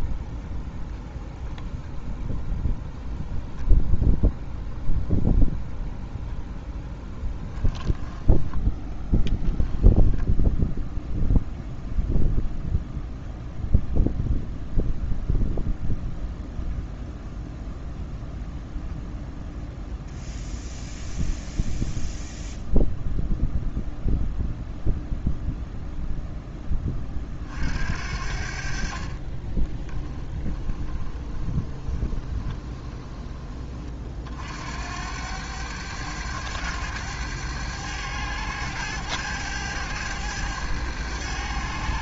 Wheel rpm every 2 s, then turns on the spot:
0, 0, 0, 0, 10, 0, 0, 0, 0, 0, 0, 0, 0, 30, 40, 20, 20, 80, 100, 100, 100.
28-34